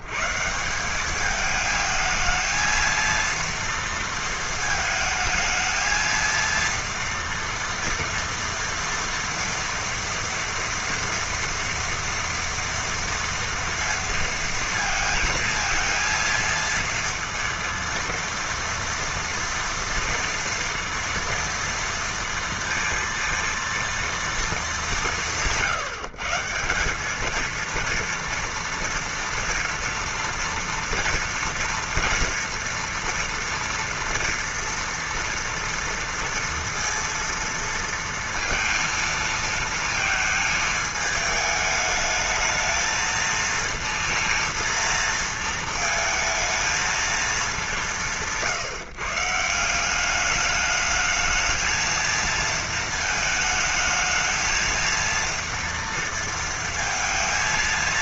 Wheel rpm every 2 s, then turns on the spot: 80, 220, 230, 230, 230, 230, 230, 230, 230, 230, 230, 230, 230, 160, 230, 230, 230, 230, 230, 230, 220, 220, 230, 220, 170, 200, 230, 220, 230.
none